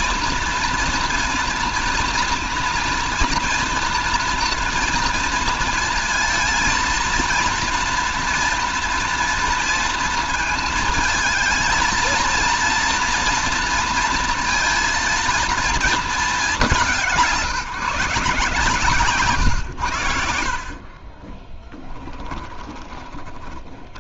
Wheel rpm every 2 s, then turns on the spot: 240, 230, 230, 230, 230, 220, 230, 230, 200, 140, 70, 20.
22-24